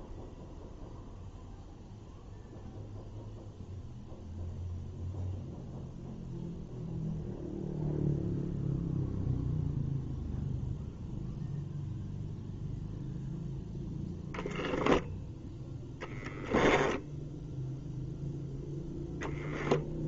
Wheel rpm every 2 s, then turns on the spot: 0, 0, 0, 0, 0, 0, 0, 0, 10, 10.
16-18